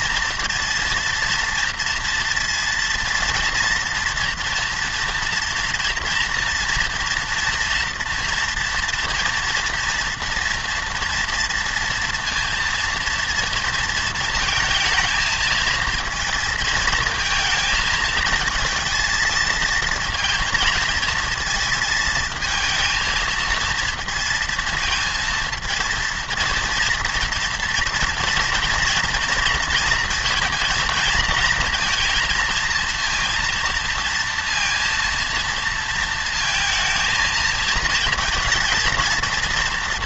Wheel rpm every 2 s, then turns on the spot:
230, 230, 230, 230, 230, 230, 230, 230, 220, 220, 230, 230, 220, 230, 230, 230, 230, 230, 230, 230.
none